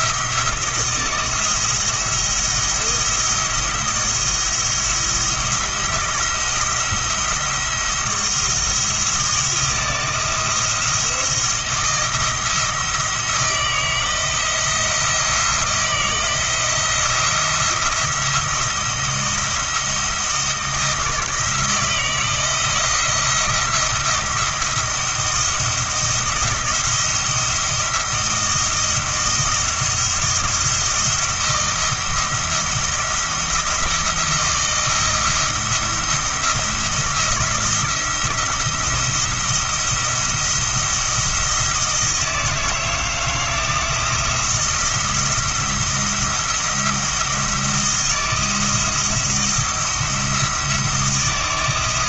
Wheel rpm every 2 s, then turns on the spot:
170, 170, 170, 170, 170, 170, 170, 170, 170, 170, 160, 170, 170, 170, 170, 170, 170, 170, 170, 170, 170, 160, 170, 170, 170, 170.
none